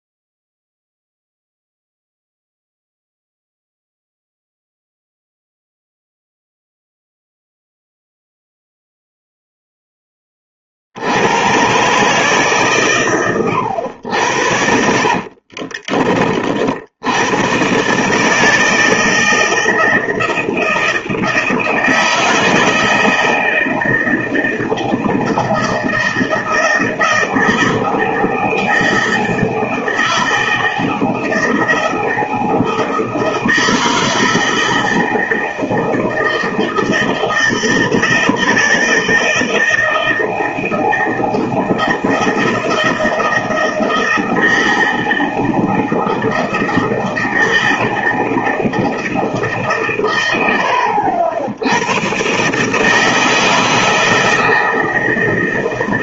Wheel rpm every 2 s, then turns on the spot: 0, 0, 0, 0, 0, 50, 140, 70, 70, 160, 160, 160, 160, 160, 160, 160, 160, 160, 160, 160, 160, 160, 160, 160, 160, 80, 150, 160.
14-16